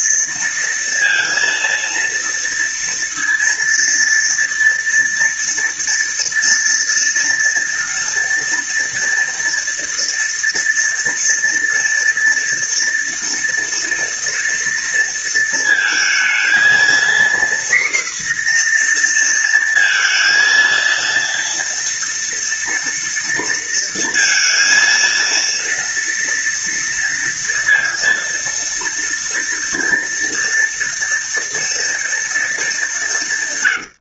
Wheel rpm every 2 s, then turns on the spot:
230, 230, 230, 230, 230, 230, 230, 230, 230, 240, 230, 230, 230, 230, 230, 230, 180.
none